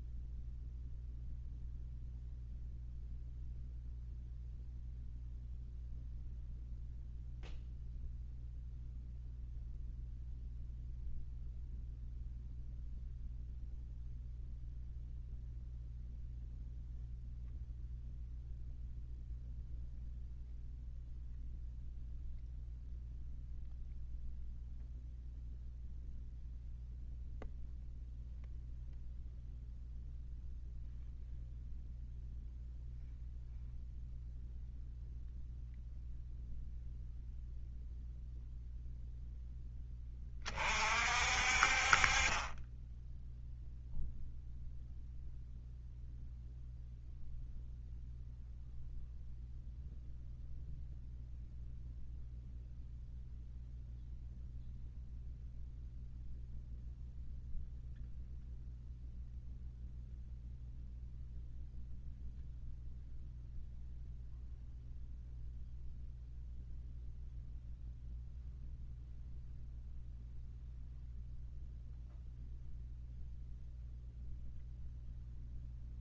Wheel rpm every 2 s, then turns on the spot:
0, 0, 0, 0, 0, 0, 0, 0, 0, 0, 0, 0, 0, 0, 0, 0, 0, 0, 0, 0, 50, 10, 0, 0, 0, 0, 0, 0, 0, 0, 0, 0, 0, 0, 0, 0, 0, 0.
none